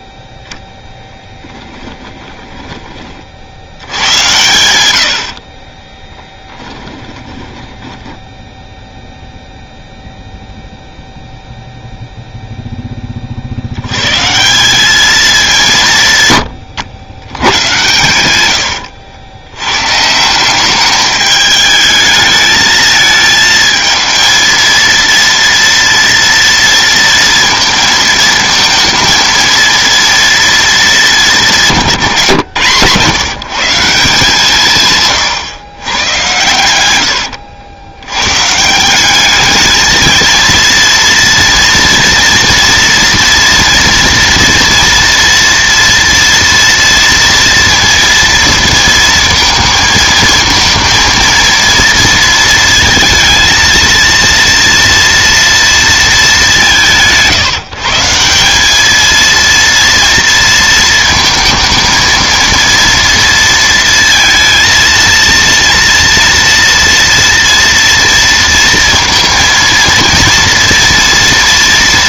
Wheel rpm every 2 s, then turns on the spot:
10, 20, 100, 20, 0, 0, 0, 190, 120, 110, 190, 220, 230, 230, 230, 230, 150, 160, 100, 150, 230, 230, 230, 230, 230, 220, 230, 230, 190, 200, 230, 230, 230, 230, 230, 230.
6-8 18-20